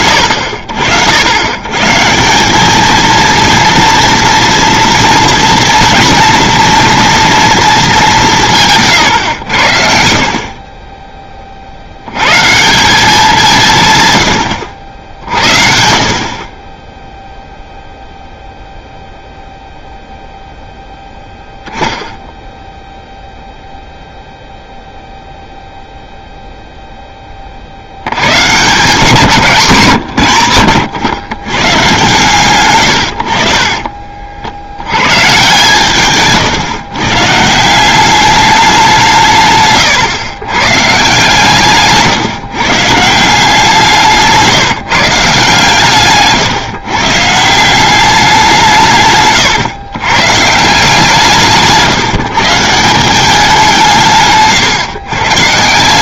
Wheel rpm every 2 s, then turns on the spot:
80, 220, 230, 230, 150, 20, 170, 70, 30, 0, 0, 0, 0, 0, 170, 120, 120, 90, 130, 190, 140, 140, 160, 140, 160, 150, 160, 130.
8-10